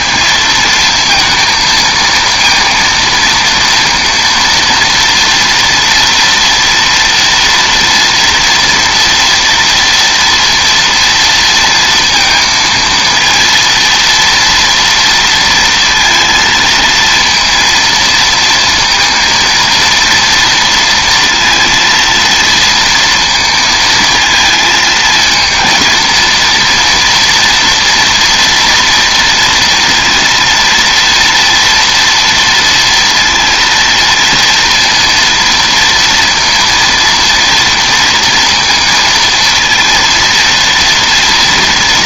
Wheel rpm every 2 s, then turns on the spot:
230, 230, 230, 230, 230, 230, 230, 230, 230, 230, 230, 230, 220, 230, 240, 230, 230, 230, 230, 230, 230.
none